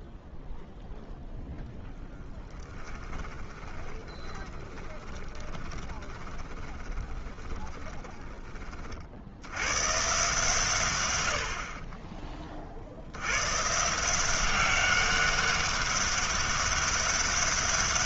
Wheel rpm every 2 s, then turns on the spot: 0, 10, 20, 20, 40, 120, 70, 190, 200.
2-8